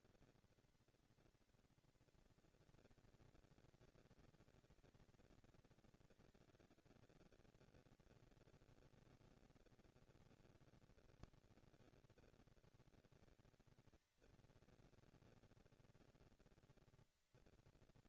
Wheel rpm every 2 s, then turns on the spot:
230, 230, 230, 220, 230, 240, 230, 230, 230.
none